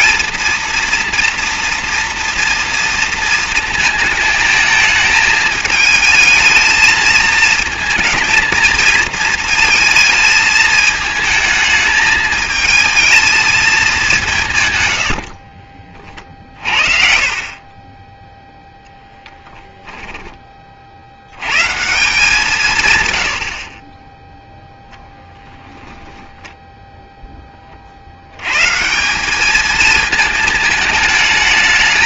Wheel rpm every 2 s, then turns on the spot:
230, 230, 220, 220, 220, 220, 220, 80, 50, 10, 70, 110, 0, 10, 140, 220.
14-16